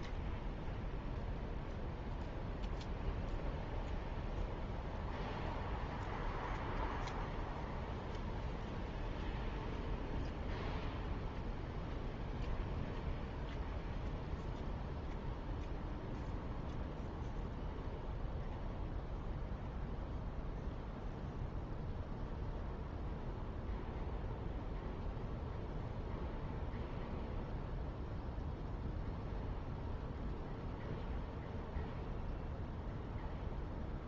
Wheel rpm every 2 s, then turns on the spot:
0, 0, 0, 0, 0, 0, 0, 0, 0, 0, 0, 0, 0, 0, 0, 0, 0.
none